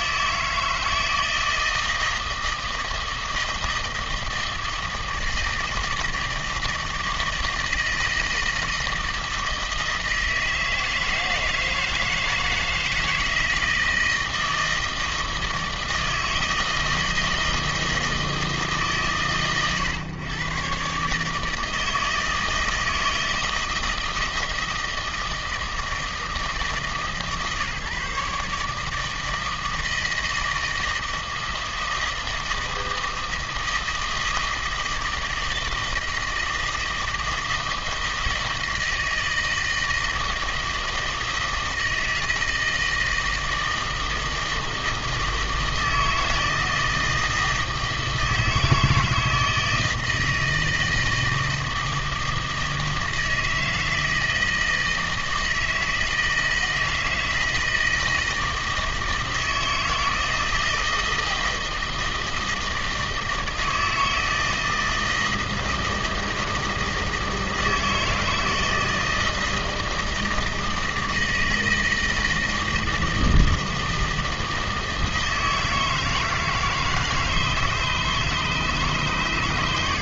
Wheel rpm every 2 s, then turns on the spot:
160, 160, 160, 160, 160, 160, 160, 160, 160, 150, 120, 160, 160, 150, 150, 160, 160, 160, 160, 160, 160, 160, 160, 160, 160, 160, 160, 160, 160, 160, 160, 160, 160, 160, 160, 160, 160, 160, 160, 150.
none